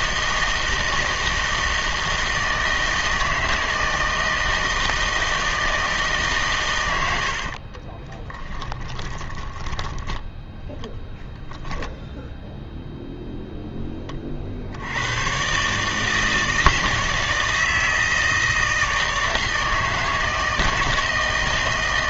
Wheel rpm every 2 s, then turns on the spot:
160, 160, 160, 120, 20, 10, 0, 60, 160, 160, 160.
8-10